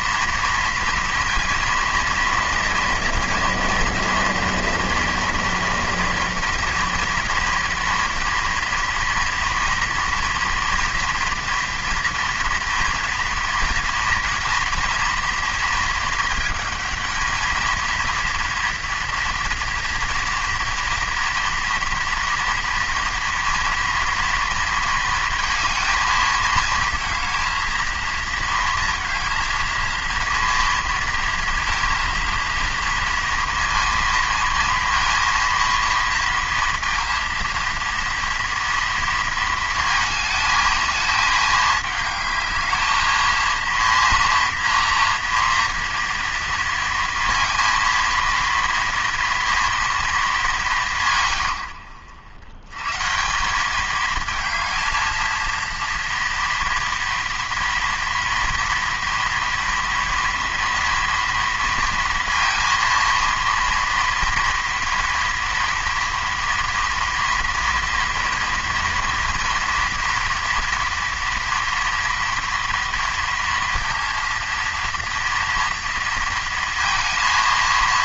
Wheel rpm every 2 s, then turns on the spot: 230, 230, 230, 230, 230, 230, 230, 230, 220, 230, 230, 230, 230, 220, 230, 230, 230, 230, 230, 230, 220, 210, 230, 230, 230, 200, 110, 220, 230, 230, 230, 230, 230, 230, 230, 230, 230, 230, 230.
none